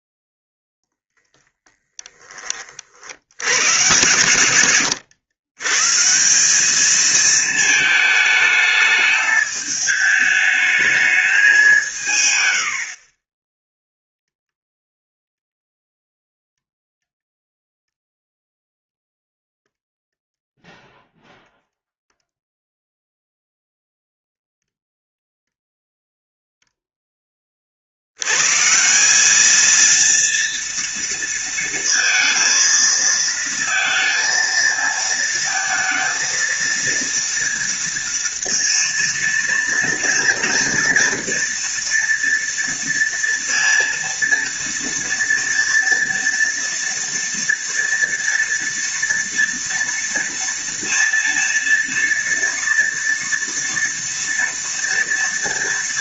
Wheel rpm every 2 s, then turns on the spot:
30, 50, 100, 210, 210, 220, 70, 0, 0, 0, 0, 0, 0, 0, 160, 230, 230, 230, 230, 230, 230, 230, 230, 230, 230, 230, 240, 240.
0-2